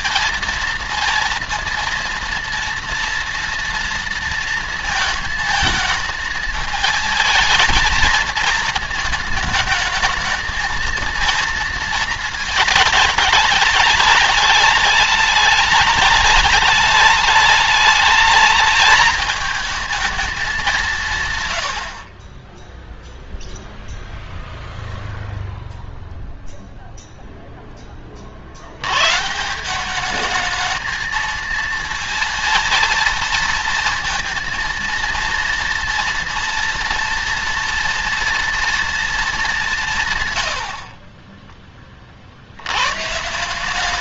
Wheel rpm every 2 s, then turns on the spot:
230, 230, 230, 220, 220, 220, 220, 210, 210, 210, 210, 30, 0, 0, 50, 210, 230, 230, 230, 230, 110, 60.
none